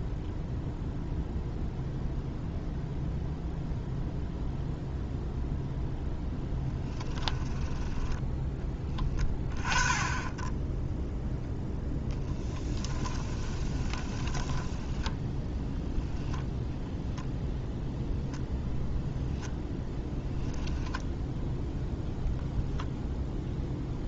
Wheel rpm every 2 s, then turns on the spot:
0, 0, 0, 10, 20, 0, 10, 20, 0, 0, 10, 0.
12-14